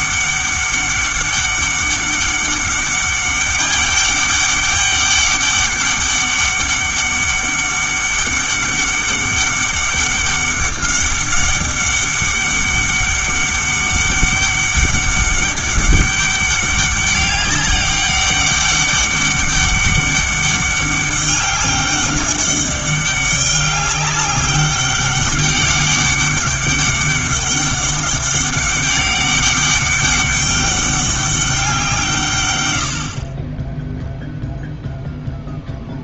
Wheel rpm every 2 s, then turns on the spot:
200, 200, 200, 200, 200, 200, 200, 200, 200, 200, 200, 200, 200, 200, 200, 200, 100, 0.
none